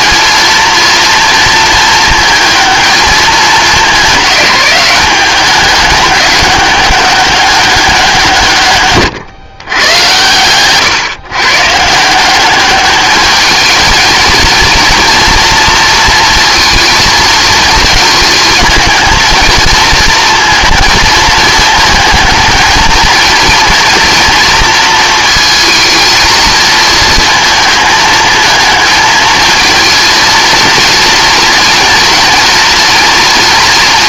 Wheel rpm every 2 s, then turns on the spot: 230, 220, 200, 200, 140, 130, 200, 230, 230, 220, 220, 220, 230, 220, 220, 230, 230.
none